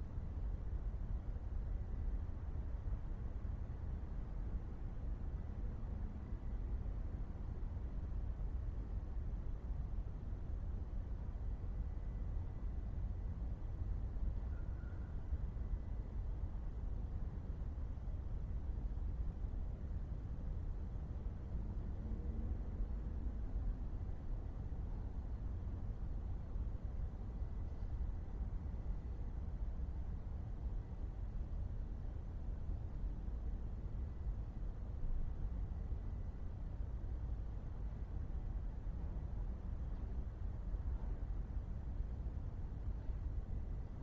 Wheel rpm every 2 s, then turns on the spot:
0, 0, 0, 0, 0, 0, 0, 0, 0, 0, 0, 0, 0, 0, 0, 0, 0, 0, 0, 0, 0, 0.
none